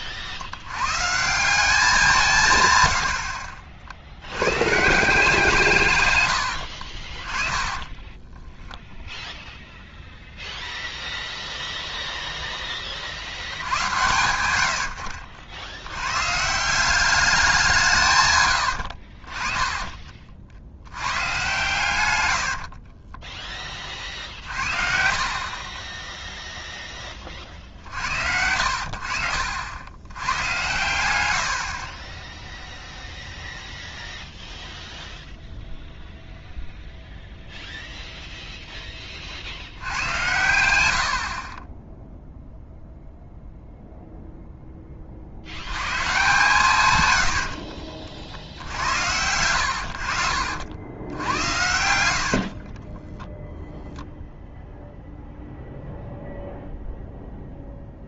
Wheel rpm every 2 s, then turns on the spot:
60, 130, 140, 70, 0, 0, 20, 80, 170, 100, 70, 50, 50, 0, 60, 110, 0, 0, 0, 10, 100, 0, 10, 130, 70, 60, 40, 0, 0.
6-8 22-26 52-54